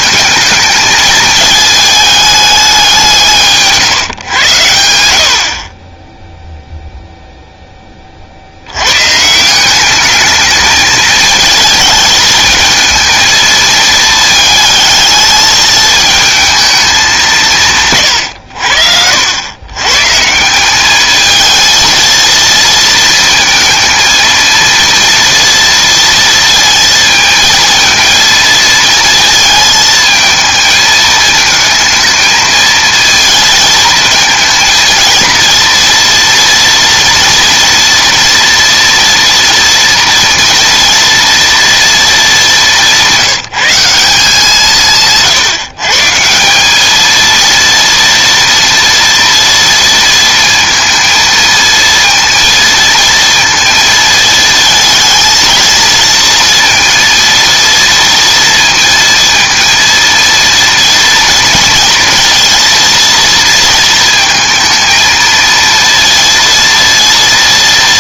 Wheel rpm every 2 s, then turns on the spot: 220, 200, 100, 0, 90, 220, 220, 220, 220, 90, 190, 230, 220, 230, 230, 220, 220, 230, 230, 230, 230, 190, 170, 190, 230, 230, 230, 230, 230, 230, 230, 230, 230, 230.
none